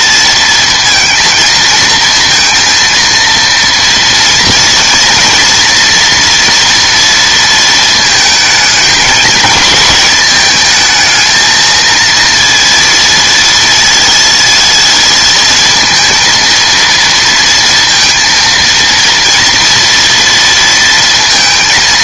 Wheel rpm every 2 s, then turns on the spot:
230, 230, 230, 230, 220, 220, 230, 220, 230, 230, 230.
none